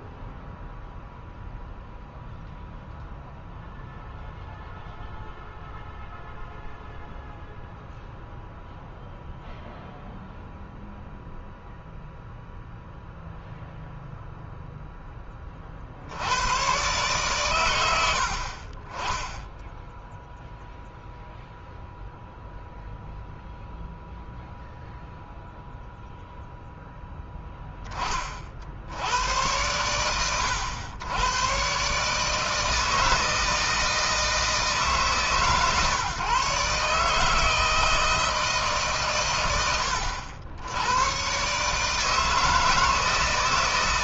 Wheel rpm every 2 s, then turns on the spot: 0, 0, 0, 0, 0, 0, 0, 0, 100, 50, 0, 0, 0, 0, 60, 100, 160, 160, 140, 150, 80, 160.
none